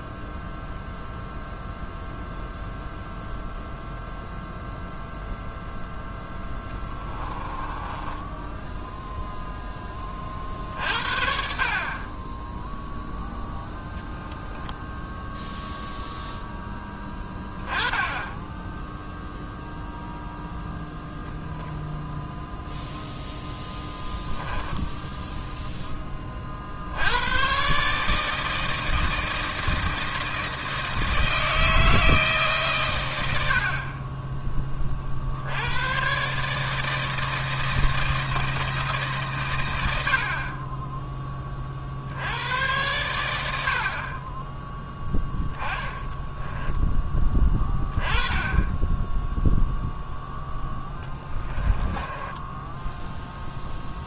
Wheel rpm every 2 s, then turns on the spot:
0, 0, 0, 20, 10, 50, 0, 0, 10, 10, 0, 0, 10, 50, 160, 160, 130, 30, 150, 160, 20, 110, 10, 10, 20, 10, 10.
6-10 24-26 46-48 52-54